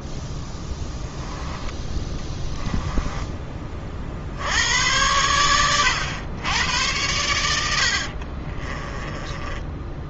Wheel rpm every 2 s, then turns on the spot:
10, 10, 90, 100, 30.
0-4 8-10